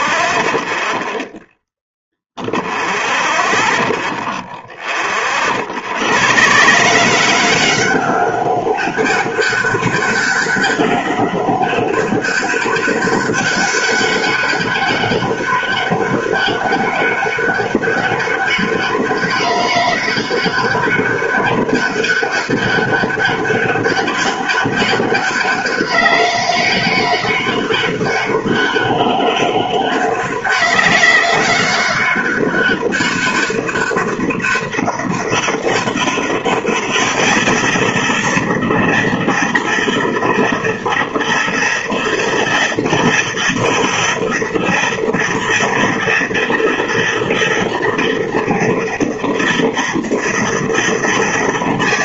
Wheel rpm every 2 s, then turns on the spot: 0, 0, 20, 170, 200, 200, 190, 200, 200, 200, 200, 200, 200, 200, 200, 200, 200, 200, 210, 230, 230, 230, 230, 230, 230, 230.
none